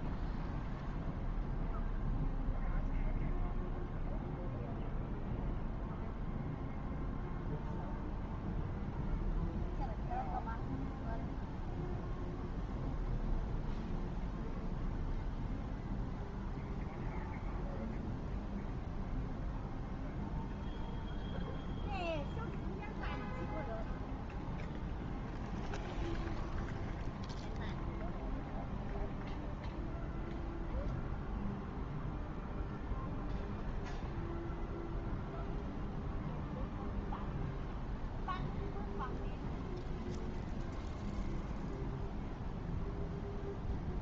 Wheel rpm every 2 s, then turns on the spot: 0, 0, 0, 0, 0, 0, 0, 0, 0, 0, 0, 0, 0, 0, 0, 0, 0, 0, 0, 0, 0, 0.
none